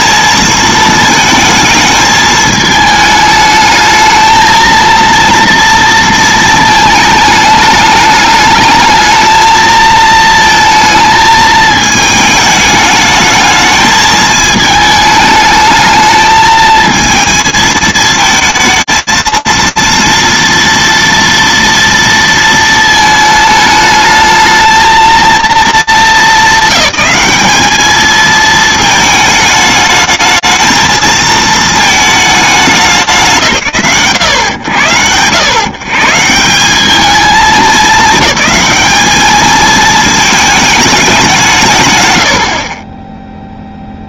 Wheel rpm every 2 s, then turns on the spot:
220, 220, 220, 220, 210, 230, 210, 220, 220, 230, 230, 220, 230, 210, 220, 230, 130, 120, 210, 220, 130, 0.
none